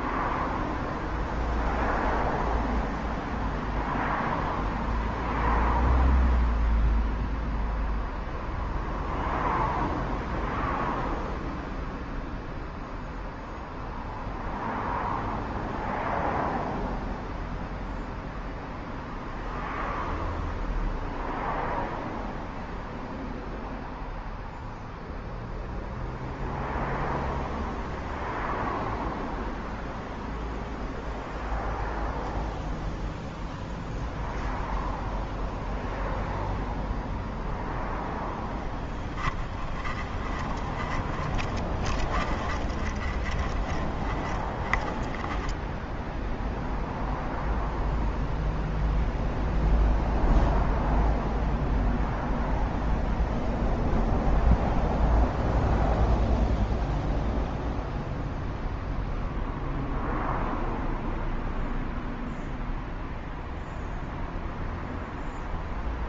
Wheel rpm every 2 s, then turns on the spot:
0, 0, 0, 0, 0, 0, 0, 0, 0, 0, 0, 0, 0, 0, 0, 0, 0, 0, 0, 10, 20, 20, 10, 0, 0, 0, 0, 0, 0, 0, 0, 0, 0.
38-46